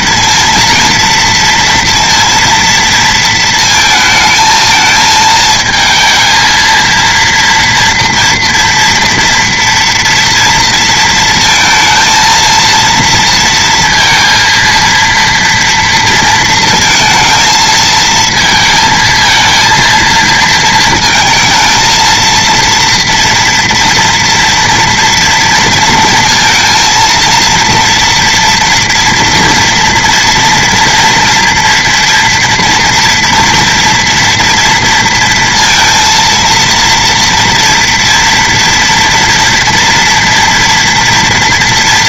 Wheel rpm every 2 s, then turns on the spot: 230, 230, 220, 230, 230, 230, 230, 230, 230, 230, 220, 230, 230, 230, 230, 230, 230, 230, 230, 230, 230.
none